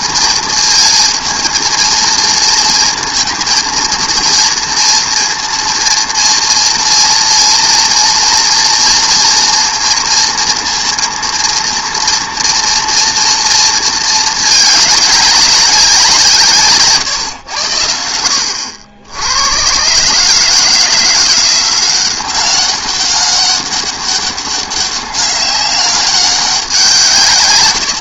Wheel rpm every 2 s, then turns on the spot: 220, 220, 230, 230, 240, 230, 240, 210, 150, 80, 160, 190, 190, 190.
none